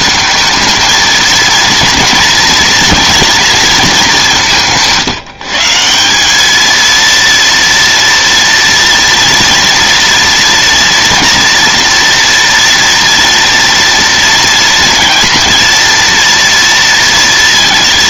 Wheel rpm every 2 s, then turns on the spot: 220, 220, 160, 230, 230, 230, 230, 230, 230.
none